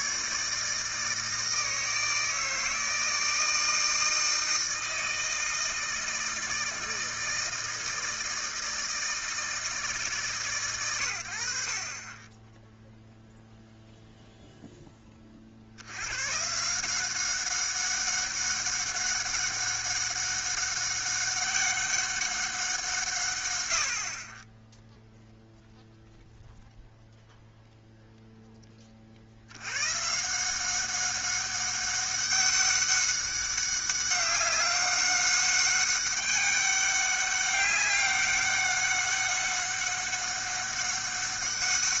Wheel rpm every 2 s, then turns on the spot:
150, 160, 160, 160, 160, 100, 0, 10, 170, 200, 200, 170, 0, 0, 10, 180, 200, 200, 200, 200, 190.
none